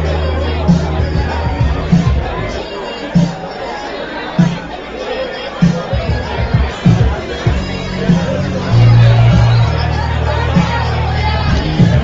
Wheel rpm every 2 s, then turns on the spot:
0, 0, 0, 0, 0, 0.
none